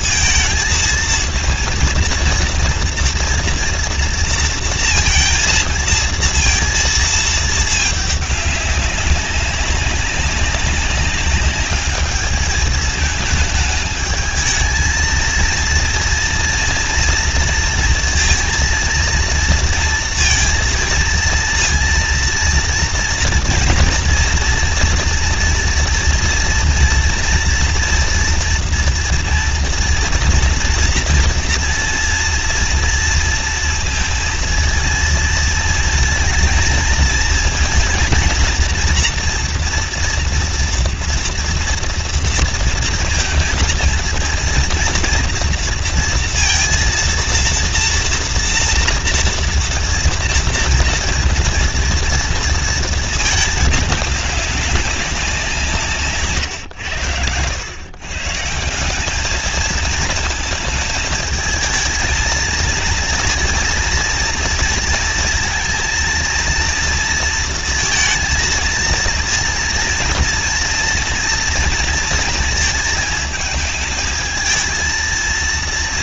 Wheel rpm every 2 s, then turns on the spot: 220, 240, 230, 230, 200, 190, 220, 220, 230, 230, 230, 230, 240, 230, 230, 230, 230, 230, 230, 230, 230, 230, 230, 230, 230, 230, 230, 200, 130, 150, 220, 230, 230, 230, 230, 230, 230, 220.
none